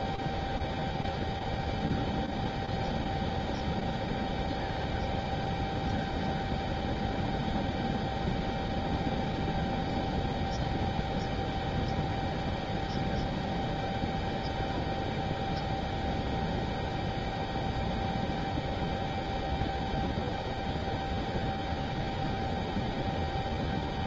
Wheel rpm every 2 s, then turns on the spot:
0, 0, 0, 0, 0, 0, 0, 0, 0, 0, 0, 0.
none